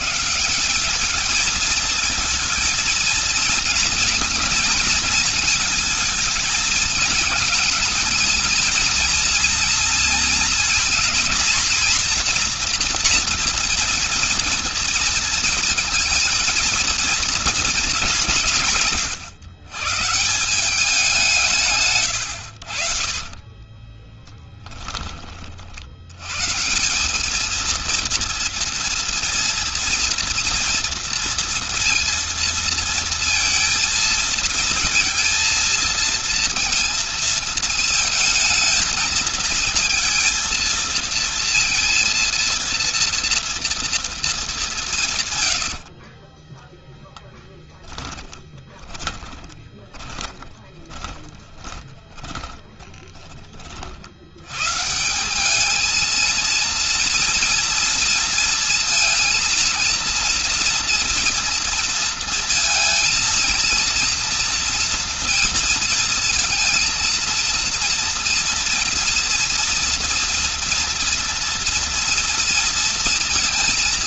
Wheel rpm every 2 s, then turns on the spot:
190, 220, 230, 230, 230, 230, 240, 230, 230, 150, 190, 70, 20, 160, 230, 230, 230, 230, 230, 230, 230, 230, 170, 0, 20, 20, 20, 130, 230, 230, 240, 230, 230, 230, 230, 230, 230.
48-54